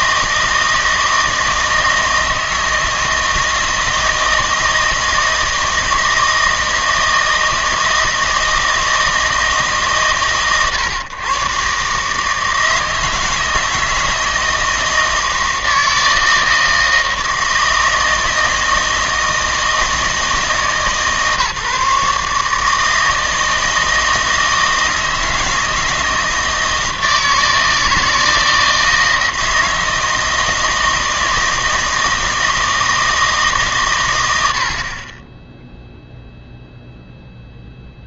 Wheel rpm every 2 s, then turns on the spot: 160, 160, 160, 160, 160, 120, 160, 160, 160, 160, 150, 160, 160, 160, 160, 160, 160, 70, 0.
none